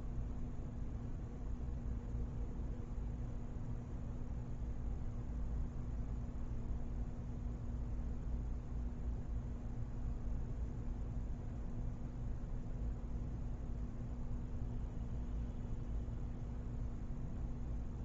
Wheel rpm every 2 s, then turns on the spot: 0, 0, 0, 0, 0, 0, 0, 0, 0.
none